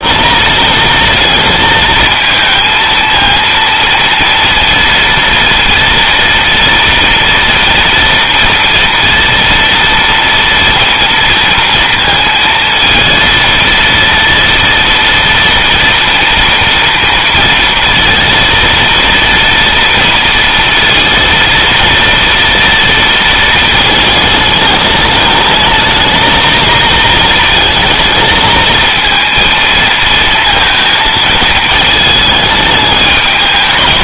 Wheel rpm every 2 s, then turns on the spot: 220, 230, 230, 230, 230, 230, 230, 230, 230, 230, 230, 230, 210, 230, 230, 220, 220.
none